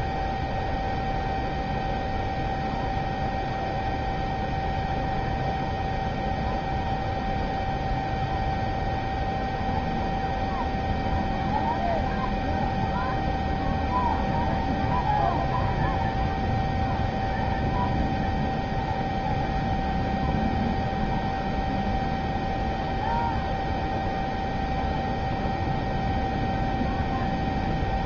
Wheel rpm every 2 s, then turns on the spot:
0, 0, 0, 0, 0, 0, 0, 0, 0, 0, 0, 0, 0, 0.
none